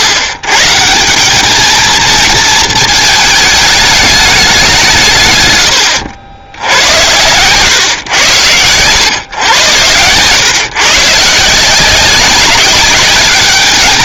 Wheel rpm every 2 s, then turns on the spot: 120, 220, 190, 80, 120, 130, 190.
none